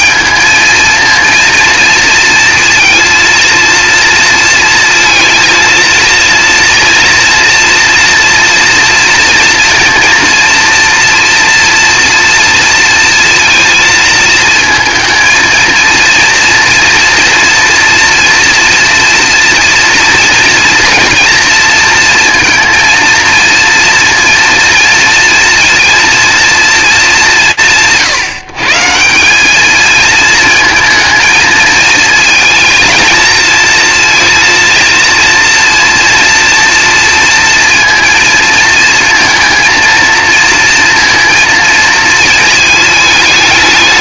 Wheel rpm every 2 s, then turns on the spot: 220, 230, 230, 230, 240, 230, 230, 220, 230, 230, 230, 230, 230, 180, 150, 220, 230, 230, 230, 230, 230, 220.
none